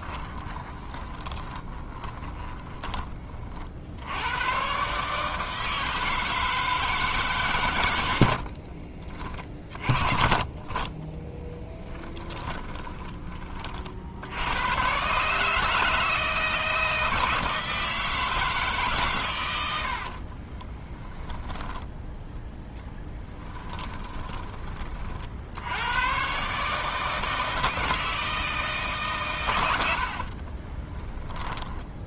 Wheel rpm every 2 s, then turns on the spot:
20, 20, 130, 150, 30, 10, 20, 120, 160, 140, 40, 10, 30, 150, 160, 30.
0-4 8-10 12-14 20-24